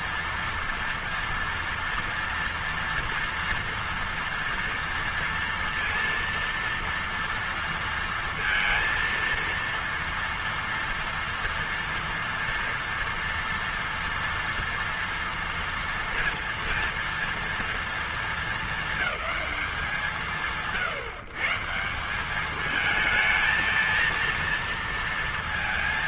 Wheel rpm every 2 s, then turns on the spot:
230, 230, 230, 230, 230, 240, 230, 230, 230, 220, 130, 200, 230.
none